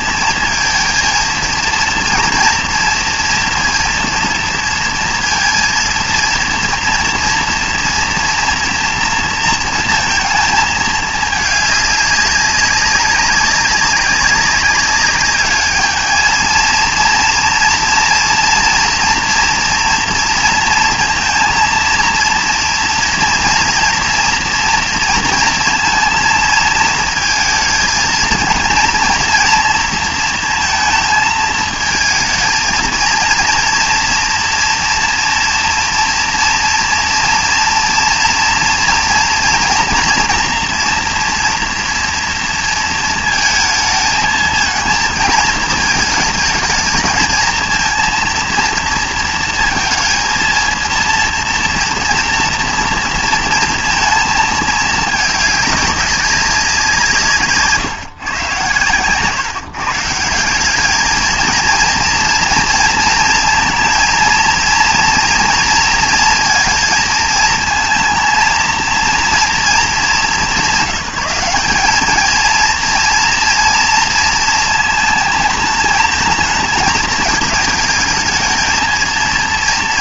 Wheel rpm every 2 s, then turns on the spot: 230, 230, 230, 230, 230, 220, 190, 200, 230, 240, 230, 230, 230, 220, 220, 230, 220, 240, 230, 230, 230, 230, 220, 220, 230, 230, 230, 220, 190, 130, 190, 230, 230, 230, 230, 180, 230, 220, 220, 220.
none